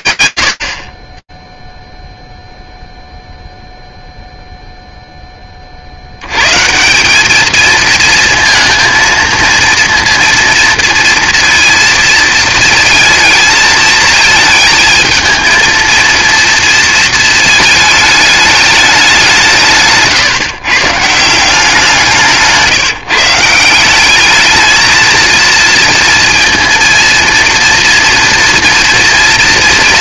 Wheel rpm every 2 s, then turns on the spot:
80, 0, 0, 180, 230, 240, 220, 220, 230, 200, 150, 160, 230, 230, 230.
none